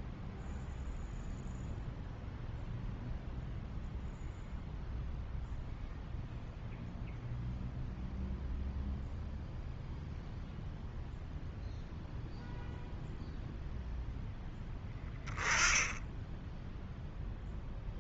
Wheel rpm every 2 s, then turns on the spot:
0, 0, 0, 0, 0, 0, 0, 10, 0.
none